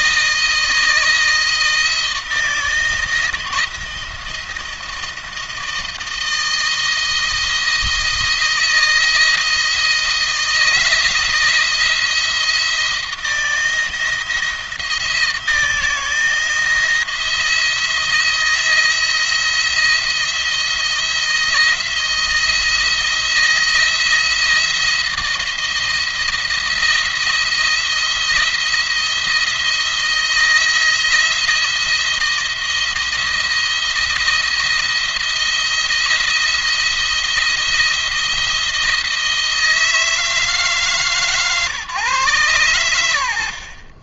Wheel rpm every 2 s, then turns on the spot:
160, 160, 160, 160, 160, 160, 160, 160, 170, 170, 170, 170, 170, 170, 170, 170, 170, 170, 170, 160, 150, 120.
none